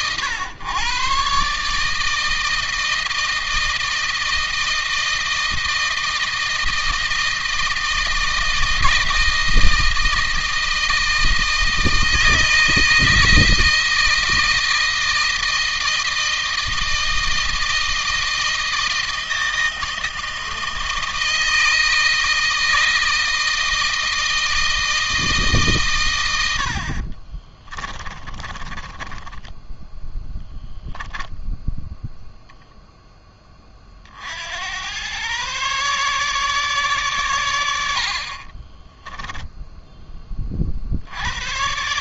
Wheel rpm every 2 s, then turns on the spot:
130, 160, 160, 160, 160, 160, 160, 160, 160, 160, 160, 160, 160, 60, 20, 10, 0, 100, 130, 20, 50.
26-30 38-40